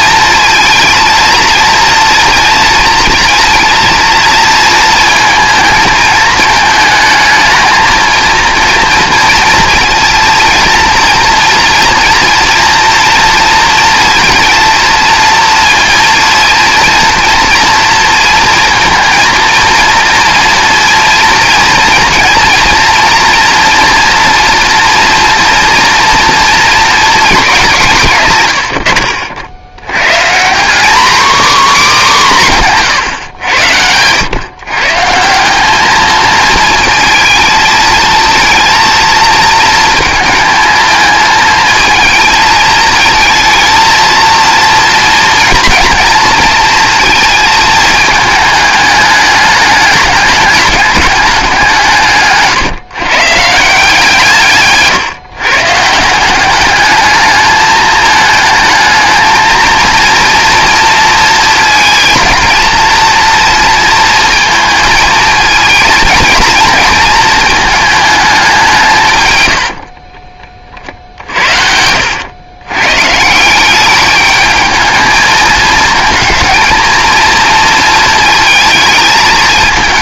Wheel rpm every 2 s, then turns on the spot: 230, 230, 230, 220, 230, 230, 240, 230, 230, 230, 240, 230, 230, 230, 110, 210, 170, 130, 230, 230, 220, 220, 230, 230, 210, 210, 140, 150, 210, 220, 230, 230, 230, 220, 170, 40, 120, 220, 230, 220.
none